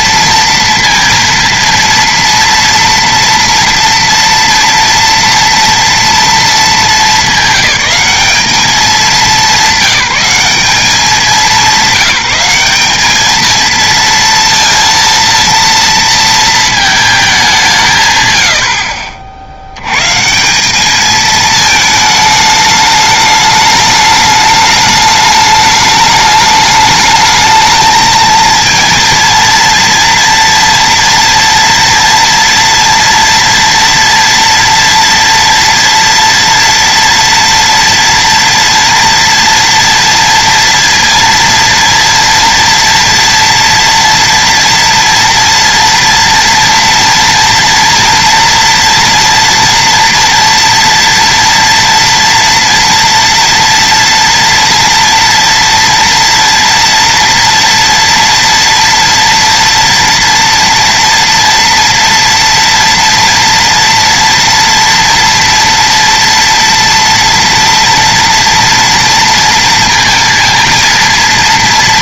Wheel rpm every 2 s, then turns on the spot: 230, 230, 230, 220, 210, 190, 190, 230, 220, 70, 190, 210, 210, 210, 230, 240, 230, 230, 230, 230, 230, 230, 230, 230, 230, 230, 230, 230, 230, 230, 230, 240, 230, 230, 230, 230.
none